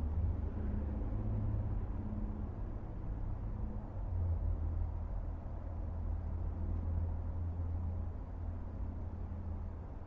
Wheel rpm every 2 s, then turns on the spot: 0, 0, 0, 0, 0.
none